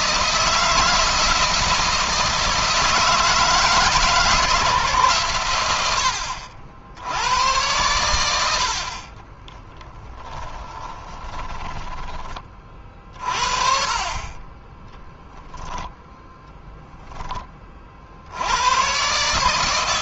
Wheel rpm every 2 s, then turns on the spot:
160, 160, 150, 90, 50, 20, 40, 10, 10, 130.
8-12 14-16